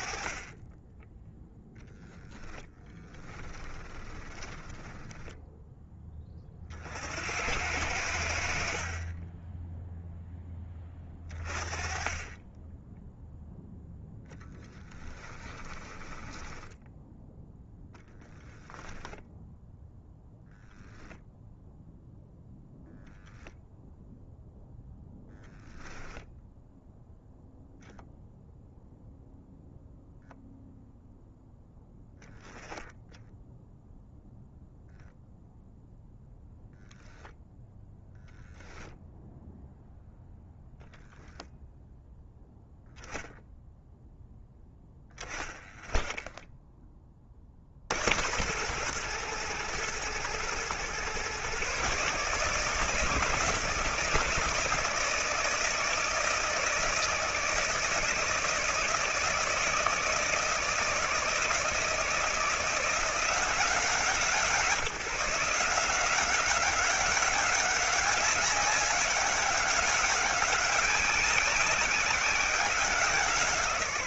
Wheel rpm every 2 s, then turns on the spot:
20, 10, 10, 50, 40, 20, 10, 10, 10, 10, 0, 0, 0, 0, 0, 0, 10, 0, 0, 0, 0, 0, 0, 20, 110, 120, 150, 160, 160, 160, 160, 170, 170, 190, 200, 190, 180.
2-6 14-18